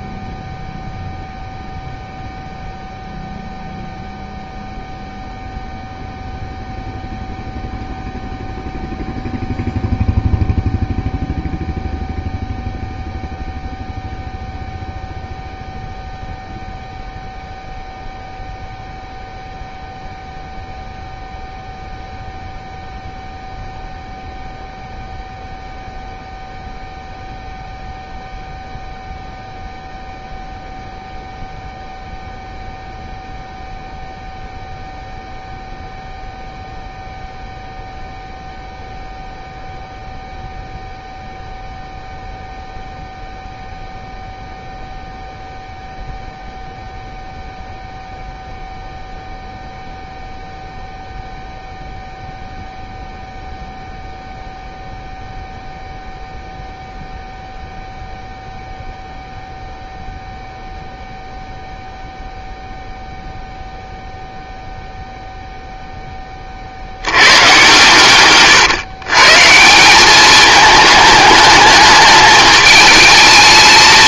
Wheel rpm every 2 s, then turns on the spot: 0, 0, 0, 0, 0, 0, 0, 0, 0, 0, 0, 0, 0, 0, 0, 0, 0, 0, 0, 0, 0, 0, 0, 0, 0, 0, 0, 0, 0, 0, 0, 0, 0, 60, 120, 210, 210.
none